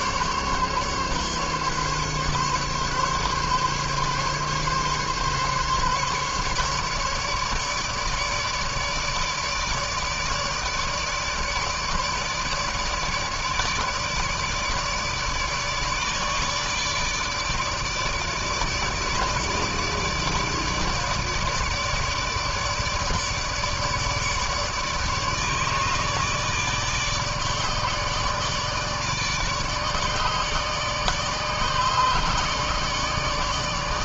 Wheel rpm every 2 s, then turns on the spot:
140, 140, 140, 150, 150, 150, 160, 150, 150, 150, 150, 150, 150, 150, 150, 150, 150.
none